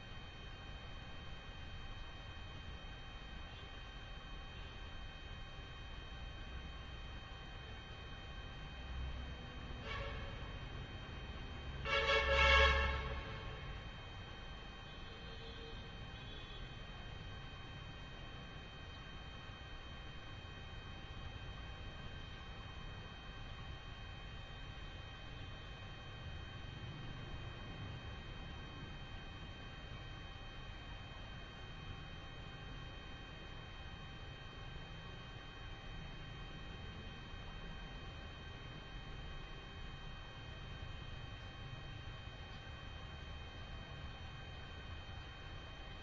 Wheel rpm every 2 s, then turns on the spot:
0, 0, 0, 0, 0, 0, 0, 0, 0, 0, 0, 0, 0, 0, 0, 0, 0, 0, 0, 0, 0, 0, 0.
none